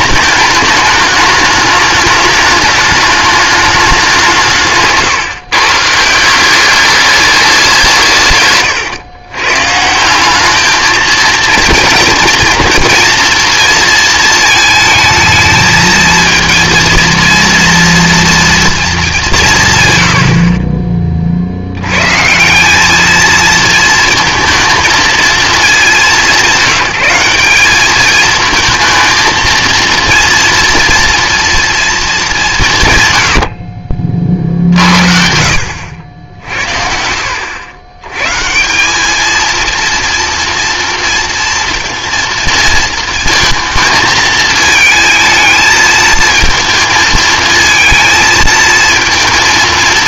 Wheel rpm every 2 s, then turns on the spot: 210, 210, 150, 200, 130, 210, 230, 220, 230, 230, 40, 190, 220, 200, 220, 240, 150, 50, 60, 180, 230, 230, 220, 220, 230.
none